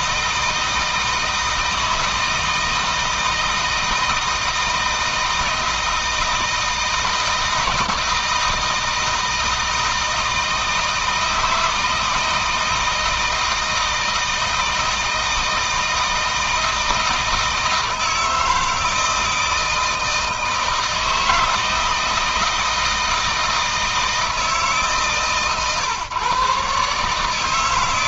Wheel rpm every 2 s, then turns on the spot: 160, 160, 160, 160, 160, 160, 160, 160, 160, 160, 160, 160, 150, 140.
none